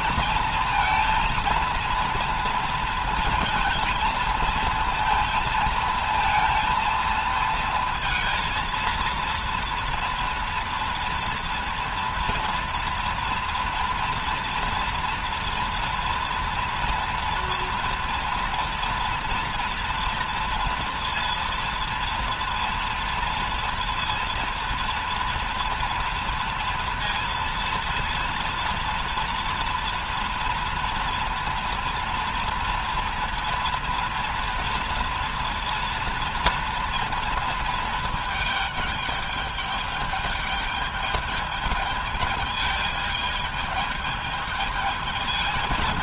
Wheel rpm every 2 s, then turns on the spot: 230, 230, 230, 220, 230, 230, 230, 230, 230, 230, 230, 230, 230, 230, 230, 230, 230, 230, 230, 210, 210, 220, 210.
none